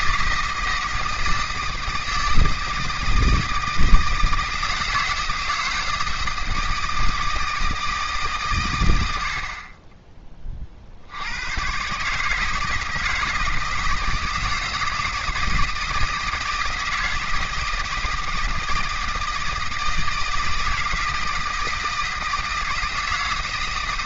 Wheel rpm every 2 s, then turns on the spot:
160, 160, 160, 160, 90, 60, 160, 160, 160, 160, 160, 160.
none